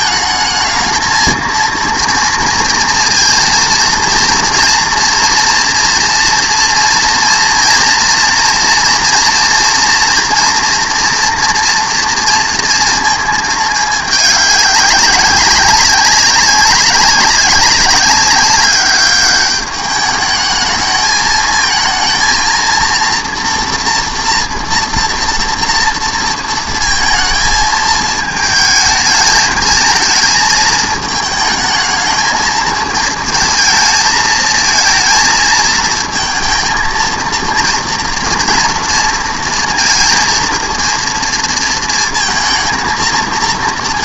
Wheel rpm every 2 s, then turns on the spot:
220, 230, 230, 230, 230, 240, 230, 200, 190, 200, 210, 230, 240, 230, 220, 220, 220, 220, 220, 230, 230, 220.
none